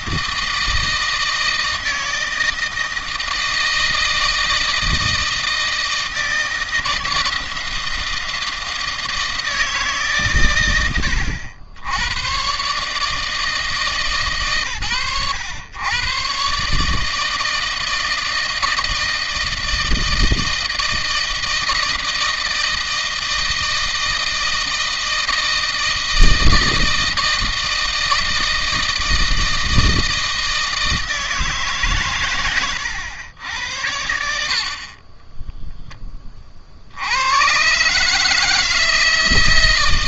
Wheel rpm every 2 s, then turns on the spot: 160, 160, 160, 160, 160, 130, 110, 120, 140, 160, 160, 160, 160, 160, 160, 160, 110, 60, 40, 150.
none